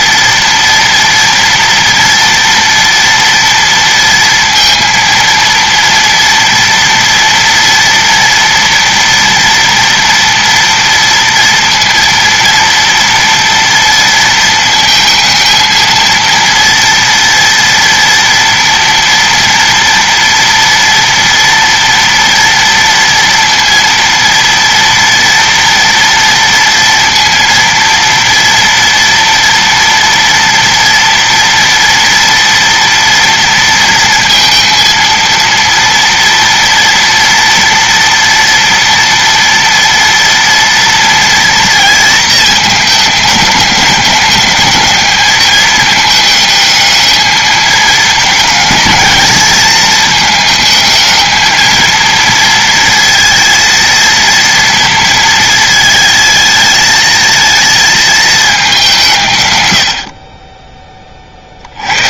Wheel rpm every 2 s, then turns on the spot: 230, 230, 230, 230, 230, 230, 230, 230, 230, 230, 230, 230, 230, 230, 230, 230, 230, 230, 230, 230, 230, 220, 210, 220, 220, 220, 230, 230, 220, 190, 20.
none